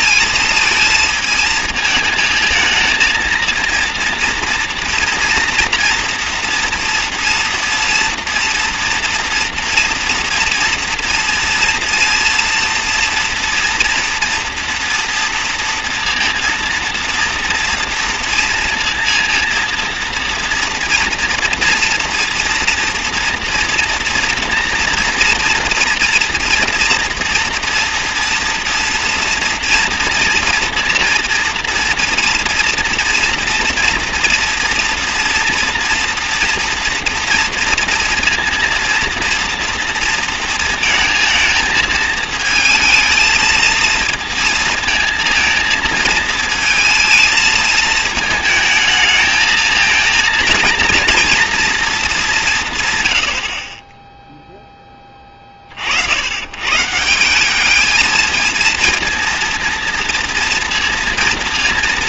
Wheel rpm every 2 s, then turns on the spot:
220, 220, 230, 230, 230, 230, 230, 230, 230, 230, 240, 240, 230, 230, 240, 230, 240, 230, 230, 230, 230, 230, 230, 220, 220, 240, 150, 10, 120, 220, 230.
none